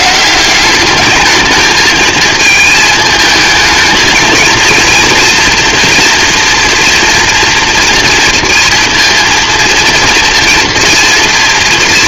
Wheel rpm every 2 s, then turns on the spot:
210, 220, 230, 230, 230, 230.
none